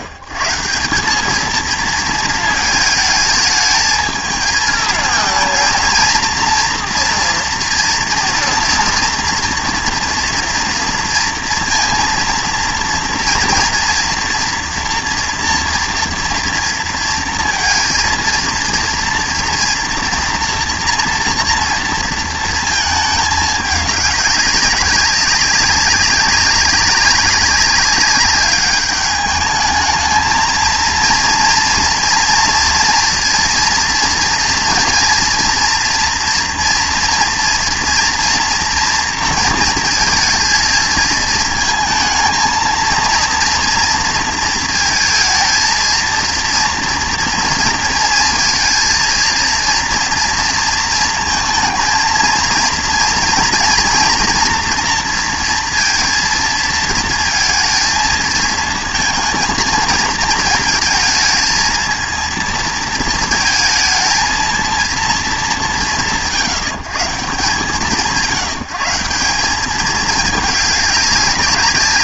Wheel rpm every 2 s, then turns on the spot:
120, 220, 220, 230, 230, 230, 230, 230, 230, 230, 230, 230, 200, 200, 200, 220, 230, 230, 240, 230, 220, 220, 230, 230, 230, 230, 230, 230, 230, 220, 220, 230, 230, 120, 160, 210.
none